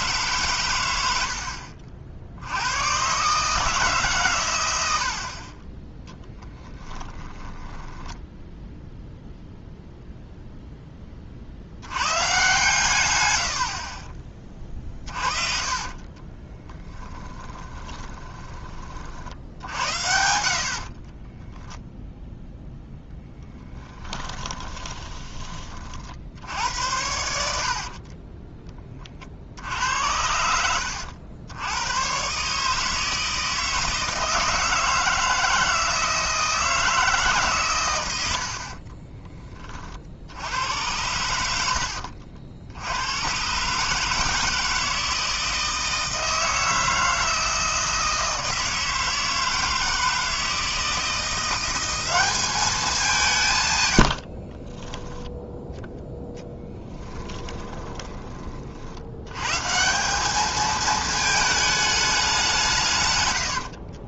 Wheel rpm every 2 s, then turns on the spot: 110, 100, 90, 20, 0, 10, 120, 30, 10, 30, 50, 0, 20, 70, 20, 90, 150, 160, 160, 50, 90, 80, 160, 160, 160, 160, 210, 30, 10, 60, 220, 160.
6-8 14-18 20-22 24-26 38-40 54-58